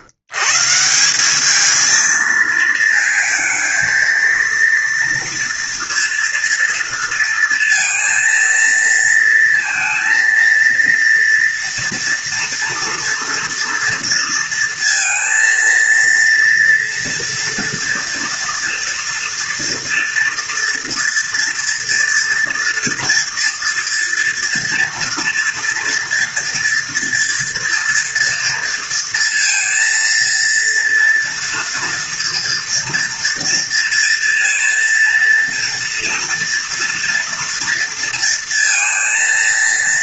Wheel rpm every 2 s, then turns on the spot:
160, 220, 230, 230, 230, 230, 230, 230, 240, 230, 230, 230, 240, 230, 230, 230, 230, 240, 240, 230.
none